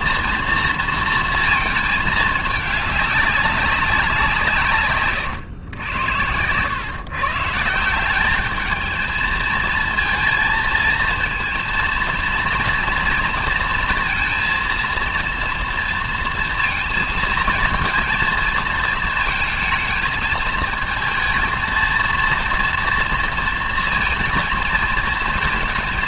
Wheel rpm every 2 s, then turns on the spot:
230, 210, 130, 110, 220, 230, 230, 230, 230, 220, 220, 230, 230.
none